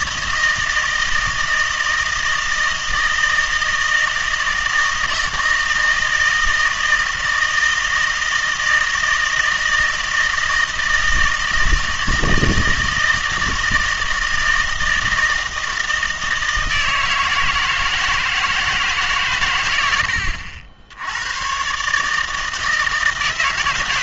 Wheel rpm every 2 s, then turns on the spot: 160, 160, 160, 160, 160, 160, 160, 160, 160, 160, 80, 160.
none